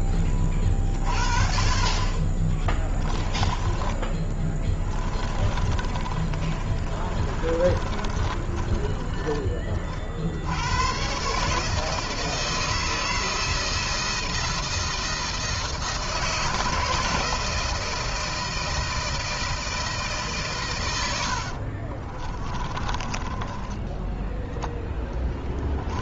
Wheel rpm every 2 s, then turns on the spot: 30, 10, 20, 30, 20, 110, 160, 160, 160, 160, 100, 20, 10.
4-10 20-26